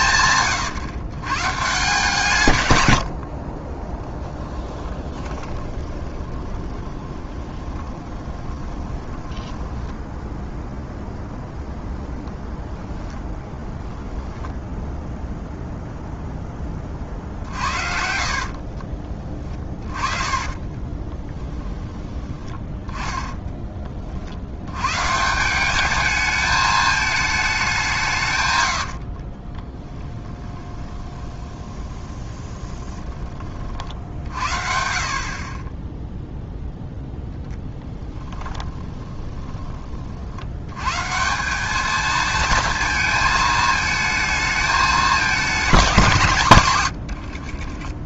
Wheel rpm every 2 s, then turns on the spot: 140, 130, 20, 20, 20, 0, 10, 0, 30, 40, 20, 10, 140, 210, 40, 20, 20, 50, 10, 20, 170, 220, 220, 110.
4-10 12-14 18-22 28-32 38-40 46-48